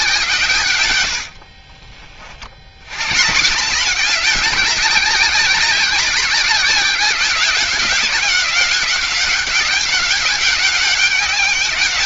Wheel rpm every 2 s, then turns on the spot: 120, 100, 190, 190, 190, 200.
none